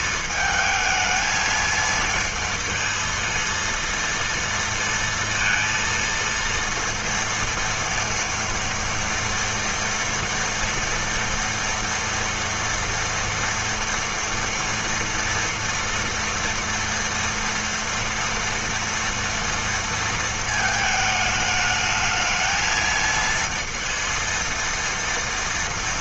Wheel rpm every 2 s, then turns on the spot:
220, 230, 230, 230, 230, 230, 240, 240, 230, 230, 220, 220, 230.
none